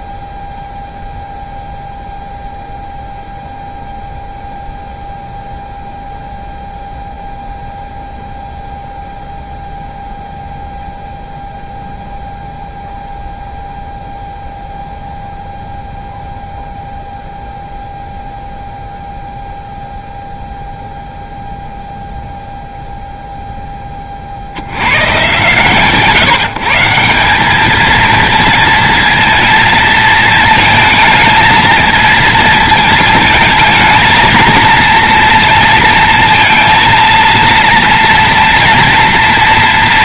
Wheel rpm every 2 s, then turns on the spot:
0, 0, 0, 0, 0, 0, 0, 0, 0, 0, 0, 0, 80, 160, 230, 220, 220, 230, 230, 230.
none